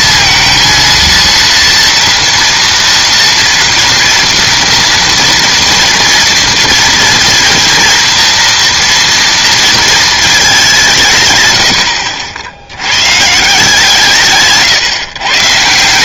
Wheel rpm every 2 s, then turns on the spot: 230, 230, 230, 230, 230, 200, 80, 140.
14-16